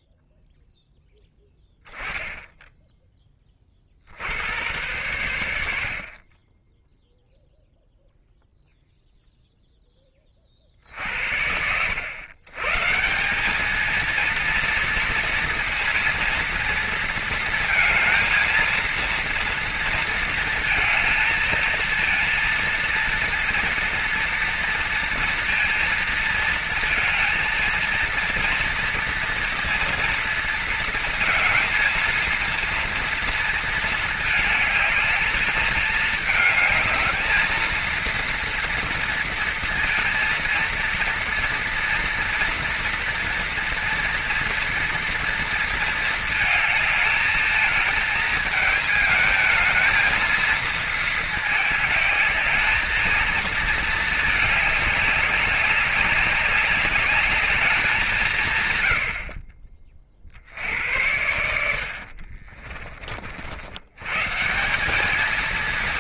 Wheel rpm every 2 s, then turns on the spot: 0, 40, 70, 0, 10, 90, 220, 230, 230, 230, 230, 230, 230, 230, 230, 230, 220, 220, 230, 230, 230, 230, 230, 220, 220, 210, 230, 190, 200, 40, 90, 60, 210.
58-60